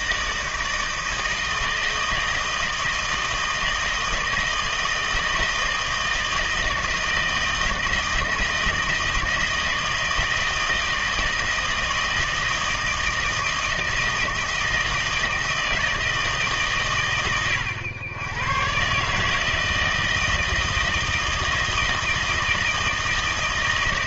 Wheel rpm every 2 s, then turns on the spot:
160, 160, 160, 160, 160, 160, 160, 160, 140, 120, 160, 160.
none